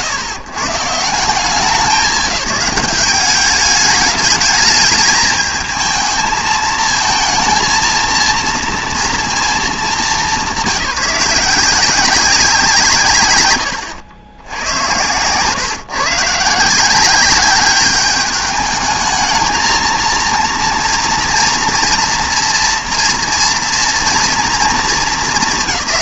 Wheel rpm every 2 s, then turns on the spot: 130, 190, 210, 220, 230, 180, 170, 120, 170, 210, 230, 230, 220.
none